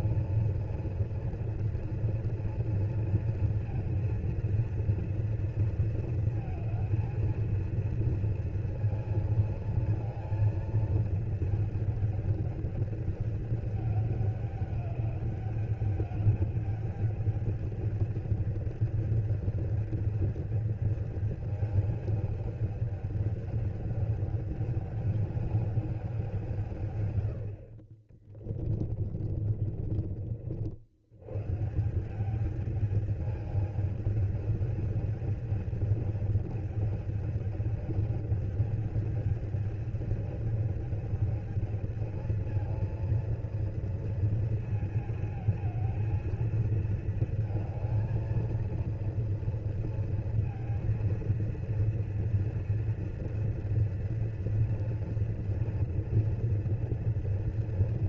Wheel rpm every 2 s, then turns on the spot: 230, 230, 230, 220, 230, 220, 210, 200, 210, 210, 210, 210, 210, 130, 40, 80, 210, 210, 220, 210, 210, 230, 230, 230, 230, 230, 230, 230, 230.
28-30